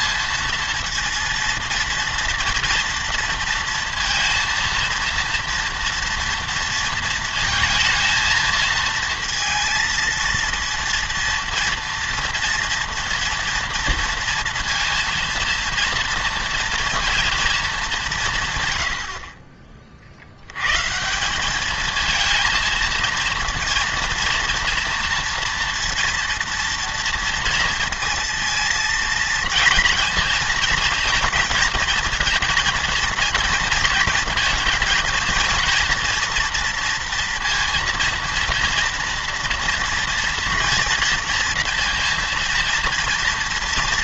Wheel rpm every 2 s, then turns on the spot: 230, 230, 230, 230, 230, 230, 230, 230, 230, 150, 90, 230, 230, 230, 230, 230, 230, 230, 240, 230, 230, 230.
none